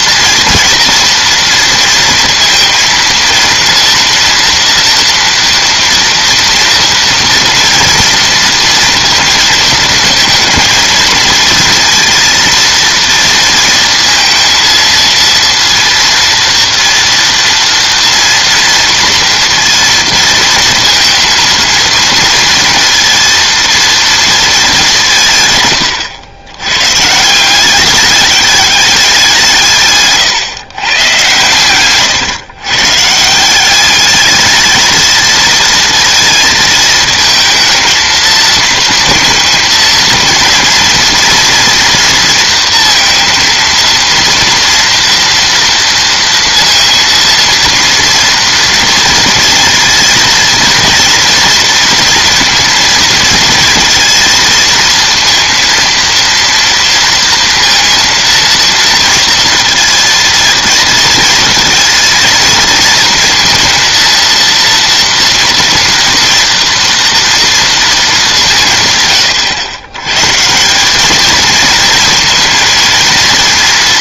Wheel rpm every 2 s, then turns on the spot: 230, 230, 230, 230, 230, 220, 230, 230, 230, 230, 230, 230, 210, 110, 200, 120, 130, 220, 220, 220, 230, 230, 230, 230, 230, 230, 230, 230, 230, 230, 230, 230, 230, 230, 160, 180, 230.
none